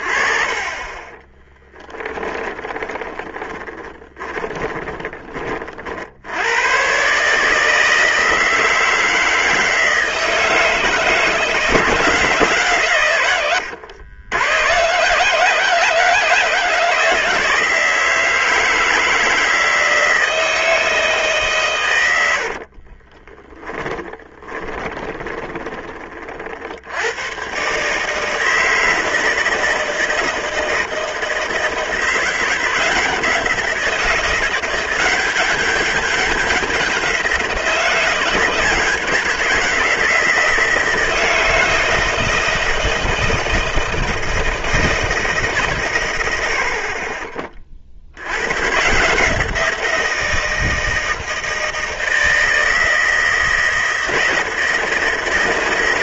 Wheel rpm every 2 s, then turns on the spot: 20, 20, 20, 120, 160, 160, 140, 120, 160, 160, 160, 40, 10, 80, 160, 160, 170, 180, 190, 170, 160, 160, 160, 60, 130, 160, 160, 160.
2-6 22-26 46-48